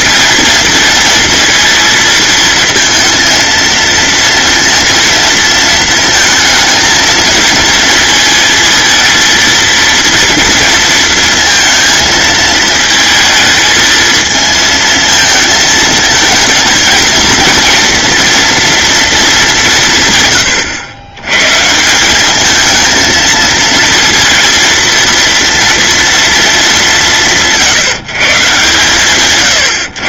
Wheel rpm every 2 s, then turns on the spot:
230, 220, 230, 220, 230, 230, 220, 220, 230, 230, 100, 220, 230, 190, 130.
none